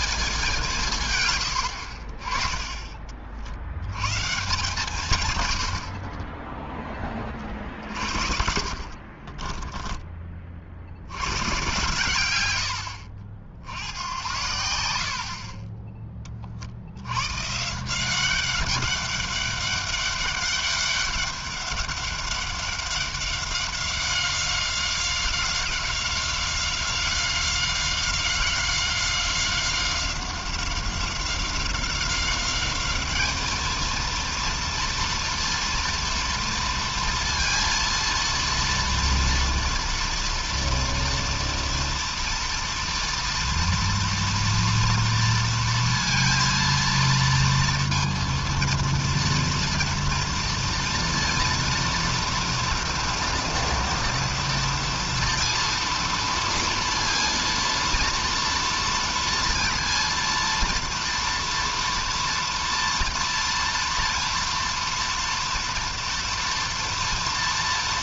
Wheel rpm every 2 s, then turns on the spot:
210, 20, 150, 20, 50, 60, 100, 90, 40, 190, 200, 190, 190, 190, 190, 190, 200, 230, 230, 230, 230, 230, 230, 230, 230, 230, 230, 230, 230, 240, 230, 230, 230, 230.
8-10